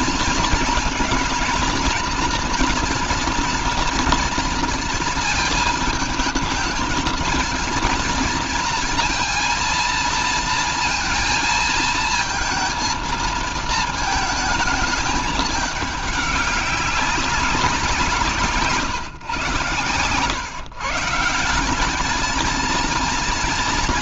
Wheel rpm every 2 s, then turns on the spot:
230, 230, 230, 220, 230, 230, 230, 220, 200, 150, 140, 220.
none